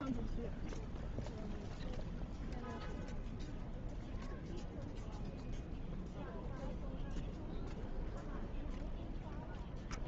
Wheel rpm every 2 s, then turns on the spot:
0, 0, 0, 0, 0.
none